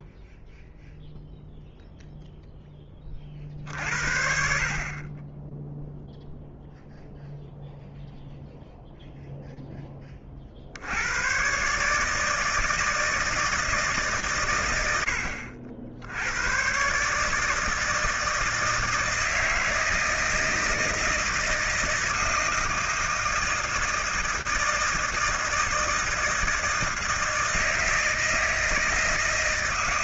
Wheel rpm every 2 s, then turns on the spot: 0, 0, 50, 0, 0, 40, 160, 120, 100, 160, 160, 160, 160, 160, 160.
none